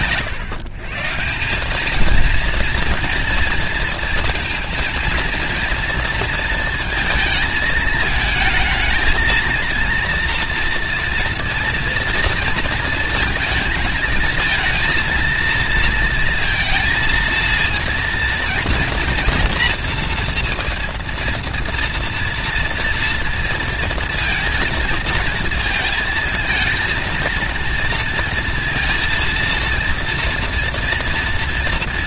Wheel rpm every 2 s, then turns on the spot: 140, 230, 230, 230, 220, 230, 230, 230, 230, 230, 230, 230, 230, 230, 230, 240.
none